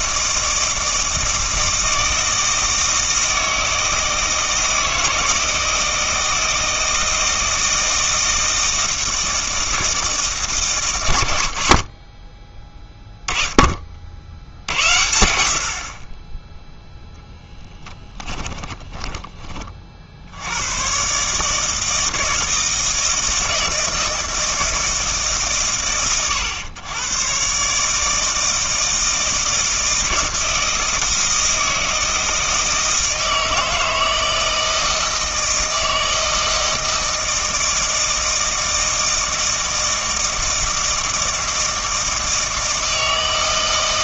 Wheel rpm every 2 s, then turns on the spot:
160, 160, 160, 160, 160, 120, 20, 90, 10, 10, 90, 160, 160, 110, 160, 160, 160, 160, 160, 160, 160, 160.
18-20